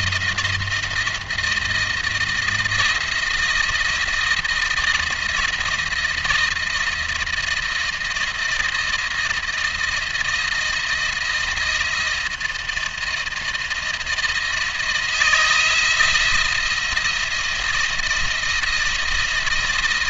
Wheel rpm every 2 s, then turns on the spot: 170, 170, 160, 170, 160, 160, 160, 160, 170, 170.
none